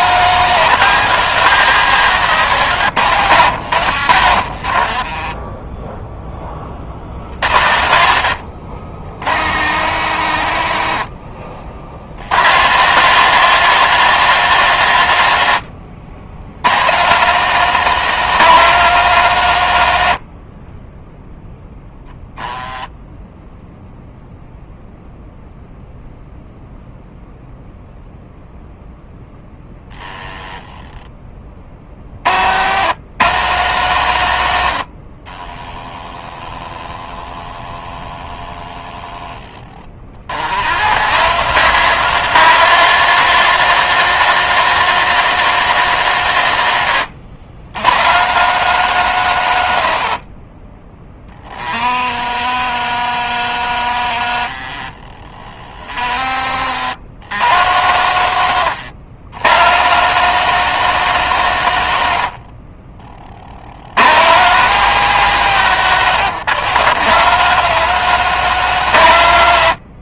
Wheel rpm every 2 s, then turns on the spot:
170, 150, 40, 60, 60, 40, 160, 130, 140, 170, 10, 10, 0, 0, 0, 10, 110, 70, 10, 10, 120, 190, 190, 110, 170, 30, 60, 40, 100, 120, 170, 40, 160, 160, 150.
2-6 8-12